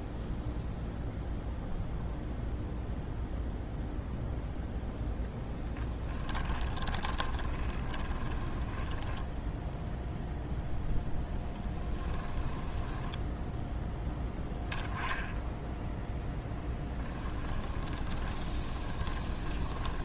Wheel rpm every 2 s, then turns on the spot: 0, 0, 0, 20, 10, 0, 10, 10, 10, 20.
6-10 12-14 16-20